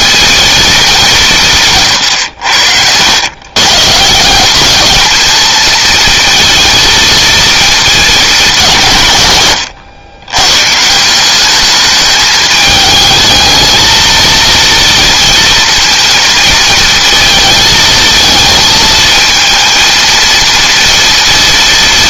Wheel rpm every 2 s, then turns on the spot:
200, 100, 220, 220, 150, 170, 210, 230, 230, 220, 230.
none